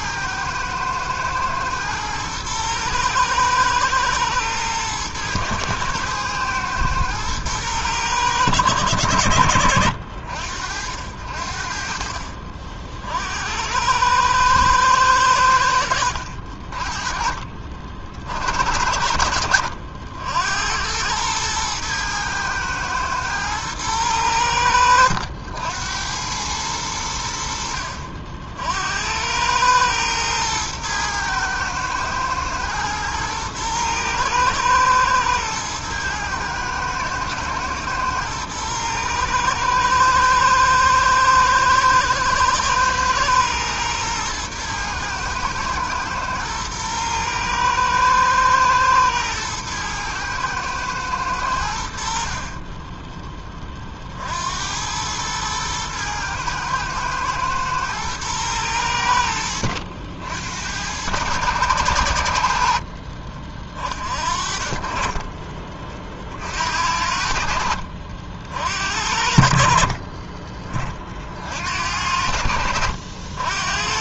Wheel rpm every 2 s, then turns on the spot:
110, 110, 110, 120, 110, 60, 40, 110, 50, 60, 80, 110, 80, 100, 70, 110, 120, 110, 110, 120, 110, 110, 110, 110, 110, 110, 30, 80, 120, 100, 90, 60, 30, 60, 60, 30, 70.
52-54 62-64 72-74